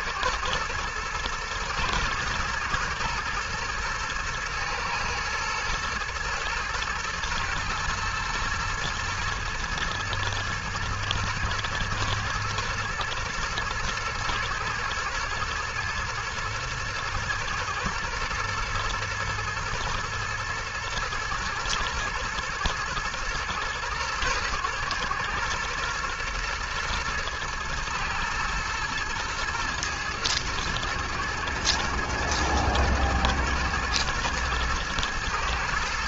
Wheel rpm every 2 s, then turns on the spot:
110, 110, 110, 110, 120, 110, 110, 120, 120, 110, 110, 110, 120, 110, 110, 110, 120, 110.
none